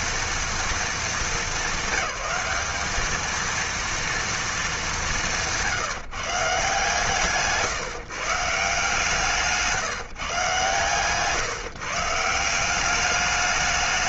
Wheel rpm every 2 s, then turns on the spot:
220, 200, 210, 150, 160, 130, 180.
none